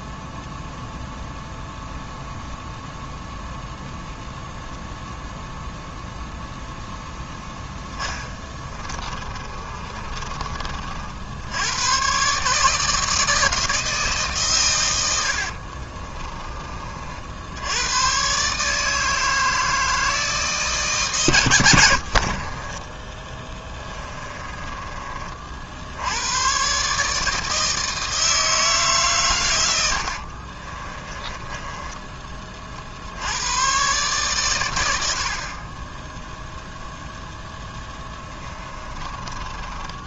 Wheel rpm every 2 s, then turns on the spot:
0, 0, 0, 0, 20, 50, 160, 110, 40, 160, 140, 20, 30, 140, 140, 30, 60, 90, 0, 20.
8-10 22-24 30-32 38-40